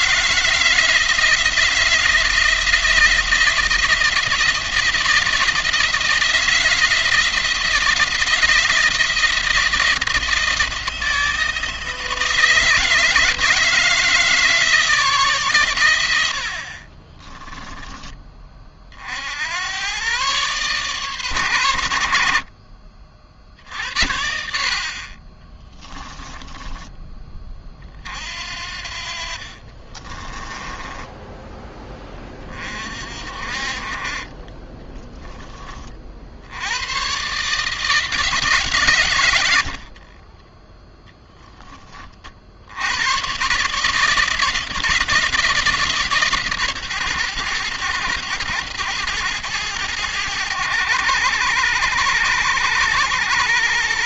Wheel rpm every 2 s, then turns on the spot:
160, 160, 170, 160, 170, 170, 160, 160, 40, 40, 140, 50, 50, 20, 50, 10, 40, 20, 100, 120, 10, 80, 160, 140, 110, 100, 100.
16-18 30-32 34-36